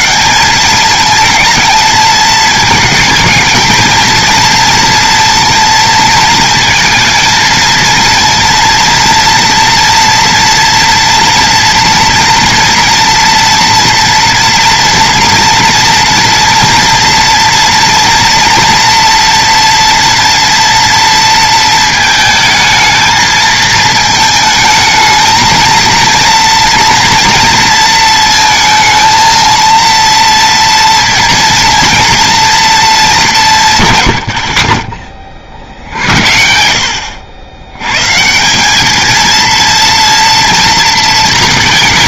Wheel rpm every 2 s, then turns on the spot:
210, 230, 230, 220, 230, 240, 230, 230, 230, 230, 230, 220, 220, 230, 220, 230, 220, 40, 70, 190, 230.
34-36